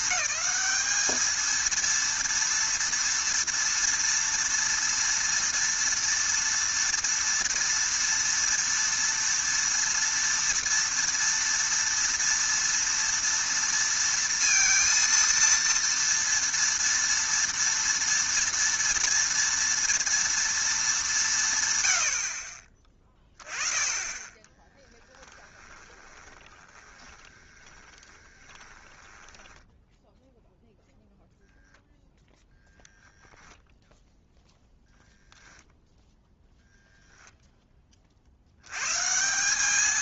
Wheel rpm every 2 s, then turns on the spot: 220, 230, 230, 230, 230, 230, 230, 230, 230, 230, 220, 30, 10, 20, 20, 0, 0, 0, 0, 110.
24-30